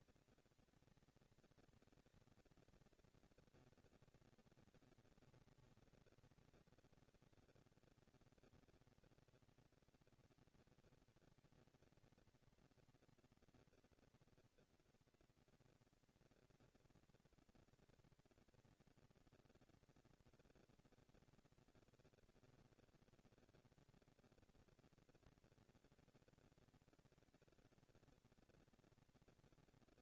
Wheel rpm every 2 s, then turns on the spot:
230, 230, 210, 200, 230, 230, 230, 230, 230, 230, 230, 230, 230, 230, 240.
none